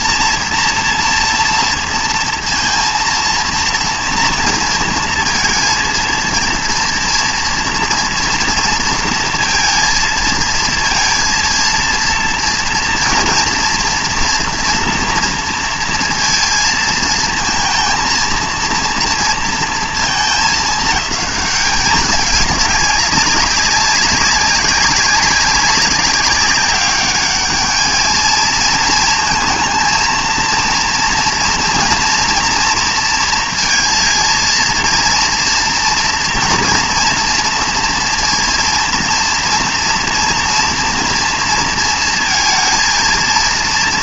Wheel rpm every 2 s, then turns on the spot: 230, 230, 230, 230, 230, 230, 240, 230, 230, 230, 210, 200, 200, 200, 230, 230, 230, 230, 230, 230, 230, 230.
none